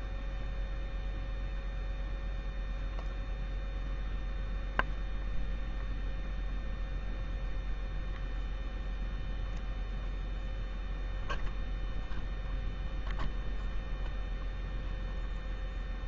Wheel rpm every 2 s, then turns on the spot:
0, 0, 0, 0, 0, 0, 0, 0.
none